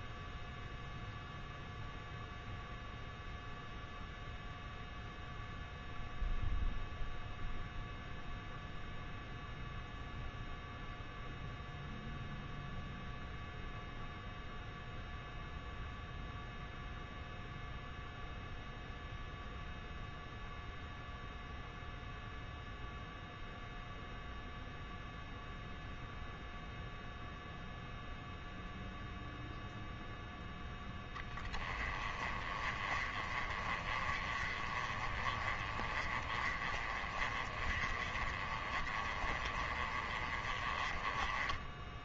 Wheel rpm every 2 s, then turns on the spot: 0, 0, 0, 0, 0, 0, 0, 0, 0, 0, 0, 0, 0, 0, 0, 10, 30, 30, 30, 30, 20.
none